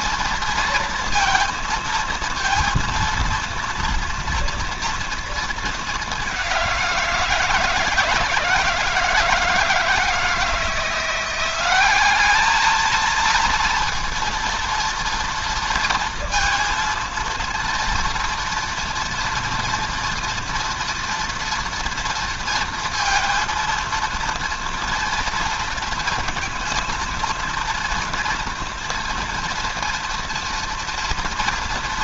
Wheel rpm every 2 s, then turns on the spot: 230, 230, 230, 180, 160, 170, 220, 230, 230, 230, 230, 230, 230, 230, 230, 230.
none